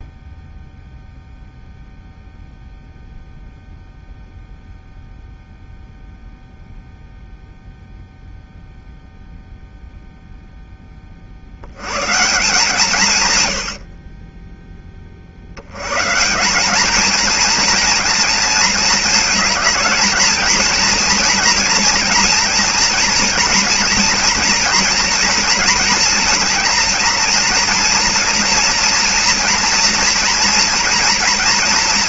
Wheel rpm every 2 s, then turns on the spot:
0, 0, 0, 0, 0, 0, 160, 10, 190, 230, 230, 240, 230, 230, 230, 230.
none